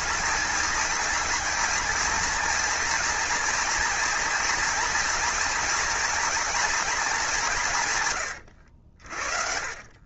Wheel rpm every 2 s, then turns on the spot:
230, 230, 230, 220, 60.
none